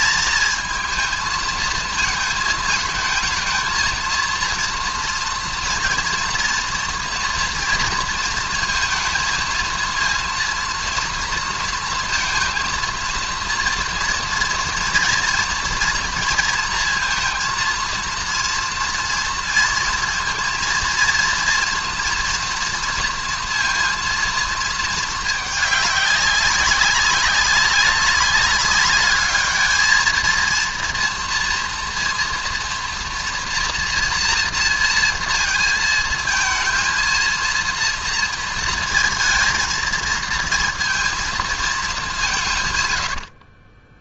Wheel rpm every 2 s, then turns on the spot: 220, 220, 230, 240, 230, 230, 230, 230, 230, 230, 230, 230, 220, 190, 200, 230, 240, 230, 230, 230, 230, 120.
none